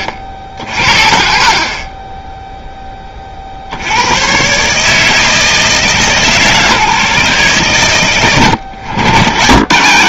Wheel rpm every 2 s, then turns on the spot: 60, 10, 150, 130, 100.
none